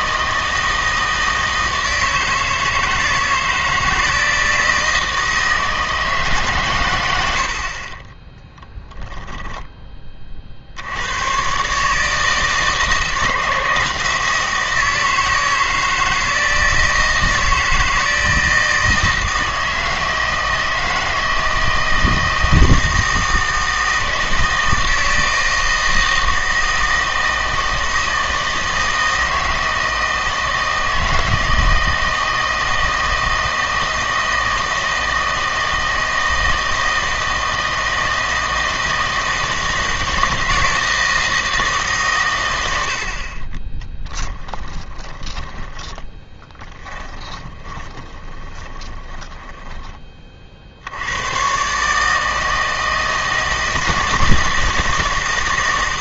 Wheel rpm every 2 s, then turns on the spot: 160, 160, 160, 130, 0, 70, 160, 160, 160, 160, 160, 160, 160, 160, 160, 160, 160, 160, 160, 160, 160, 90, 20, 20, 20, 70, 160, 160.
44-50